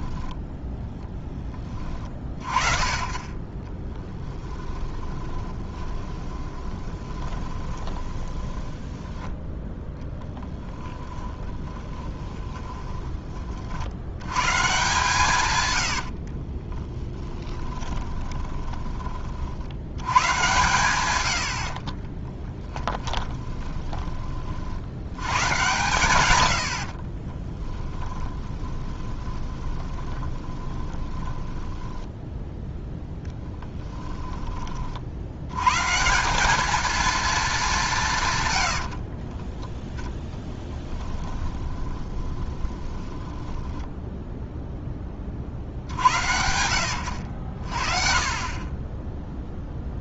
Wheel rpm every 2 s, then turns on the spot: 10, 40, 20, 20, 10, 10, 20, 140, 20, 20, 100, 10, 60, 70, 10, 20, 0, 30, 210, 90, 10, 10, 10, 80, 30.
4-14 16-20 22-24 28-32 38-44